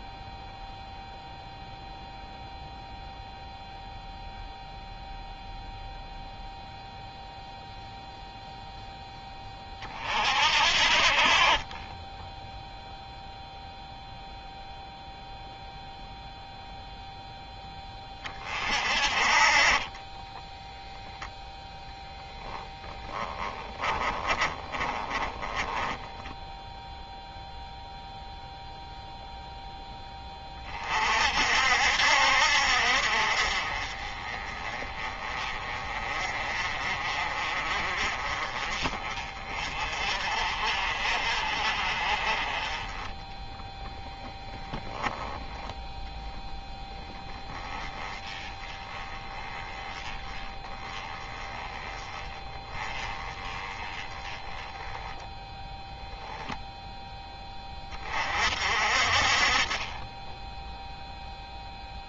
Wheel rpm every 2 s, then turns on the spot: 0, 0, 0, 0, 10, 50, 0, 0, 0, 40, 10, 10, 20, 0, 0, 40, 50, 30, 40, 30, 40, 20, 10, 10, 20, 10, 20, 10, 0, 50, 10.
22-26